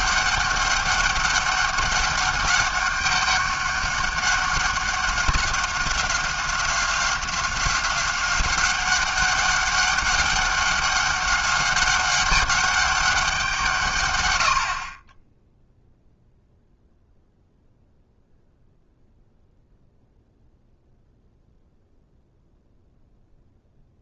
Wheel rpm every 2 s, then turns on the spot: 200, 200, 190, 190, 190, 200, 200, 70, 0, 0, 0, 0.
none